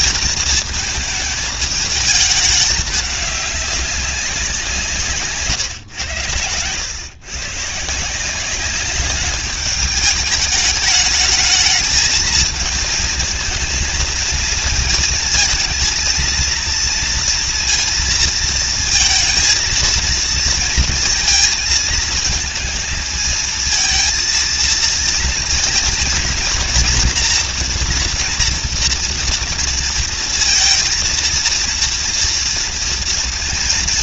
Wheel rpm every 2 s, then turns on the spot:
220, 210, 170, 110, 190, 210, 220, 220, 230, 230, 230, 220, 230, 230, 240, 230, 230.
none